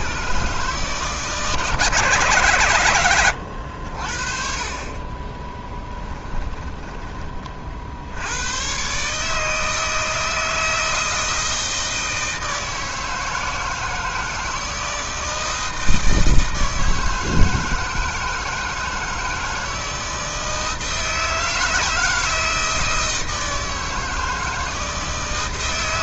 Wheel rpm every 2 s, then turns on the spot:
150, 110, 30, 20, 130, 160, 160, 160, 160, 160, 160, 160, 160.
none